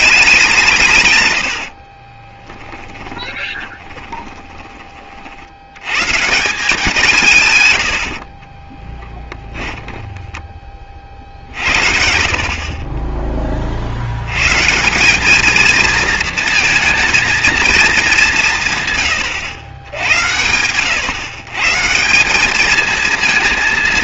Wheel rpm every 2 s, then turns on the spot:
180, 20, 20, 170, 30, 30, 40, 140, 230, 150, 100, 220.
2-4 8-10